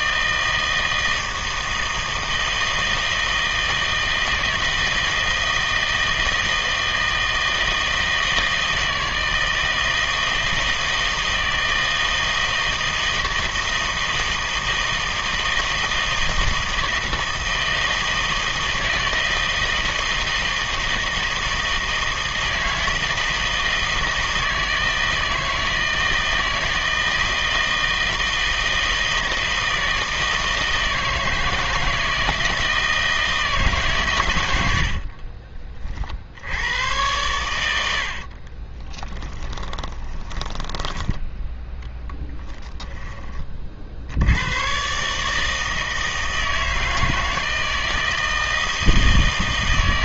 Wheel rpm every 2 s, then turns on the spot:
160, 160, 160, 160, 160, 160, 160, 160, 160, 160, 160, 160, 160, 160, 160, 160, 160, 80, 90, 30, 10, 10, 110, 160, 160.
34-36 38-40 42-44